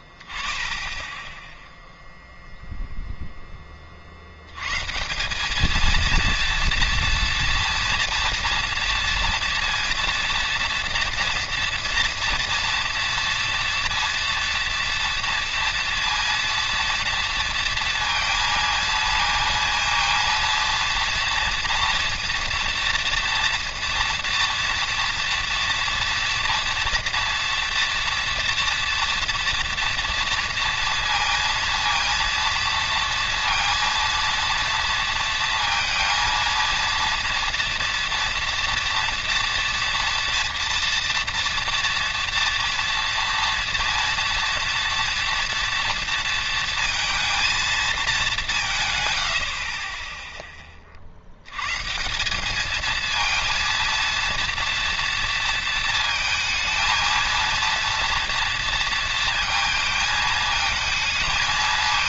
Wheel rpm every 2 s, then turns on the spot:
10, 0, 110, 230, 230, 240, 230, 230, 230, 230, 230, 230, 230, 230, 230, 230, 230, 230, 230, 240, 230, 240, 230, 230, 170, 20, 210, 230, 220, 230, 220.
none